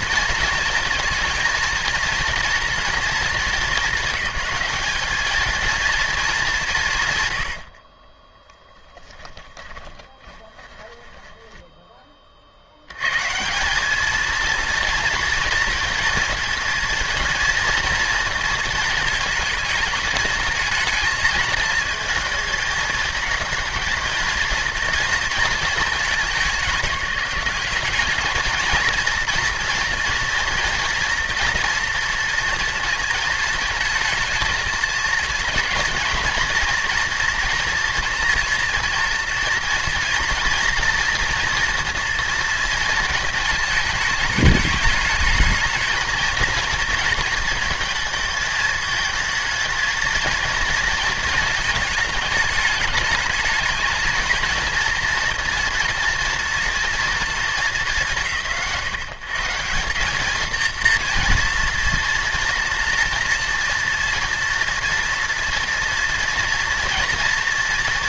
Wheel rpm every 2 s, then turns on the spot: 220, 230, 220, 120, 10, 20, 100, 230, 230, 220, 220, 220, 230, 180, 230, 230, 230, 220, 230, 230, 230, 230, 210, 230, 220, 230, 210, 230, 240, 120, 230, 230, 230, 230.
8-12